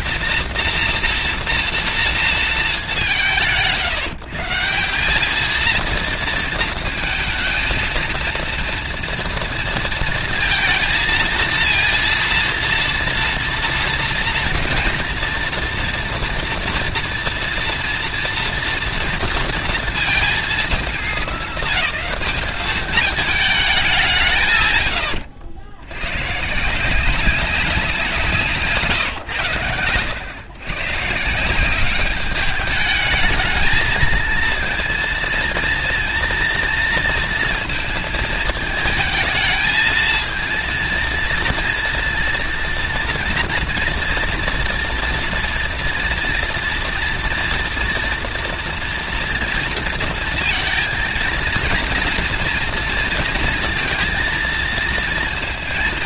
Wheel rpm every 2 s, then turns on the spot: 230, 160, 200, 220, 230, 230, 230, 230, 230, 230, 220, 210, 100, 170, 140, 150, 220, 230, 230, 220, 230, 230, 230, 230, 240, 230, 230, 230.
none